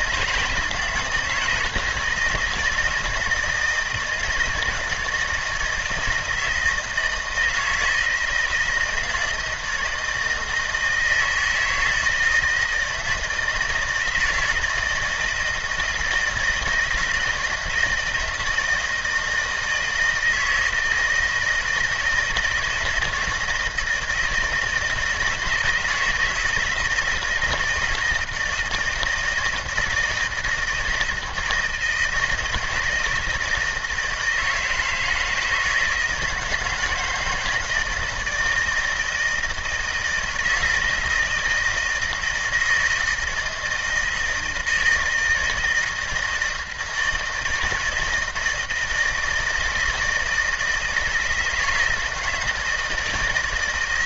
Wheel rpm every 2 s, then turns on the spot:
170, 170, 160, 160, 160, 160, 160, 170, 170, 160, 160, 160, 160, 160, 160, 160, 160, 160, 160, 160, 160, 160, 160, 160, 160, 160, 160.
none